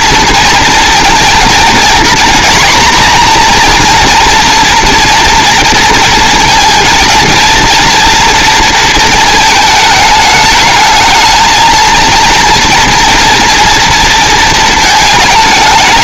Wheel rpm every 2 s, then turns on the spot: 230, 250, 240, 230, 230, 220, 230, 220.
none